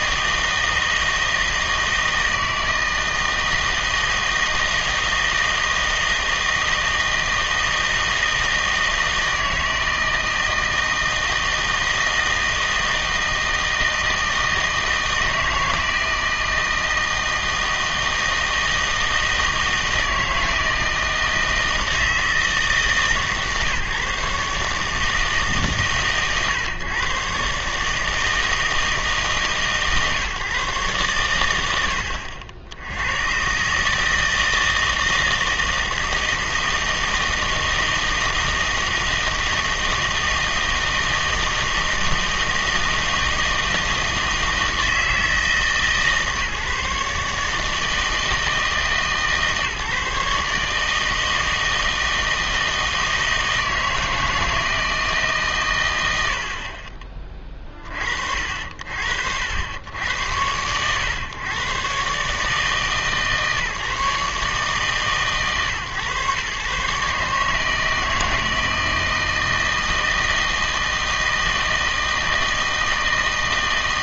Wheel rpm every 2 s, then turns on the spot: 160, 160, 160, 160, 160, 160, 160, 160, 160, 160, 160, 150, 150, 130, 150, 140, 80, 160, 160, 160, 160, 160, 160, 140, 150, 150, 160, 160, 60, 60, 110, 150, 140, 130, 160, 160, 160.
none